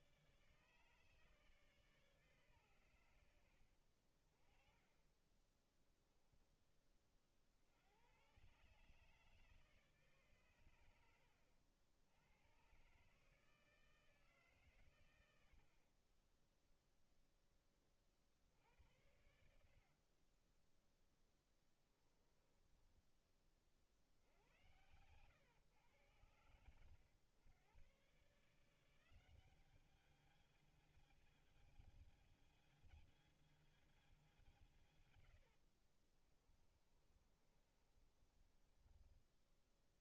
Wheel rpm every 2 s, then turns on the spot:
140, 60, 10, 80, 140, 80, 160, 40, 30, 60, 10, 60, 100, 110, 200, 220, 220, 70, 30, 0.
4-6 18-22 34-38